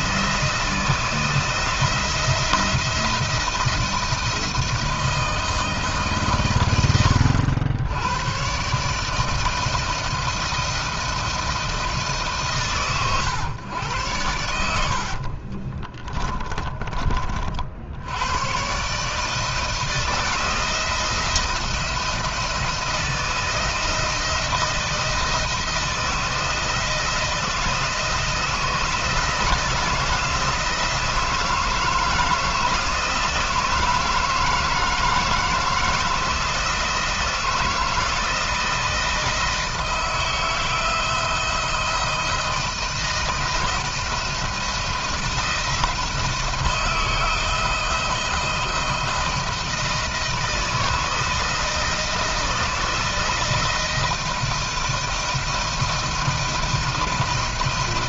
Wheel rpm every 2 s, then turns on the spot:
170, 170, 160, 100, 140, 170, 140, 70, 30, 140, 160, 160, 160, 160, 170, 160, 160, 160, 160, 160, 160, 170, 170, 160, 160, 160, 160, 160, 160.
14-16